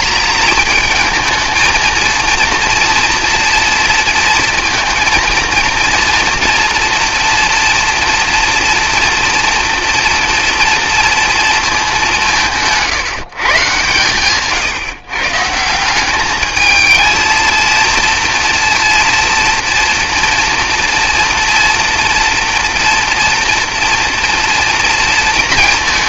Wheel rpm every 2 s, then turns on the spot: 220, 230, 230, 230, 230, 230, 160, 140, 220, 230, 230, 240, 230.
none